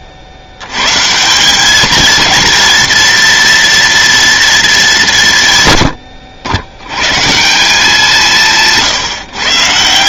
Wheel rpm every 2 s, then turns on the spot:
90, 230, 200, 110, 160.
none